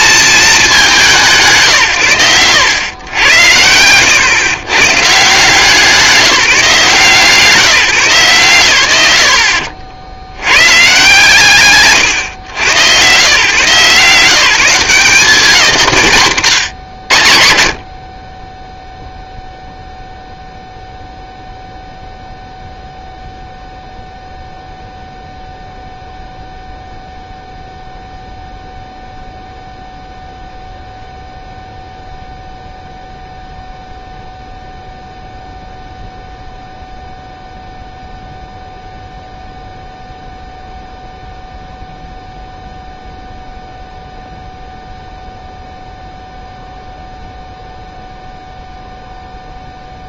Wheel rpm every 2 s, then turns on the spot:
180, 100, 130, 160, 110, 150, 120, 170, 110, 0, 0, 0, 0, 0, 0, 0, 0, 0, 0, 0, 0, 0, 0, 0, 0.
none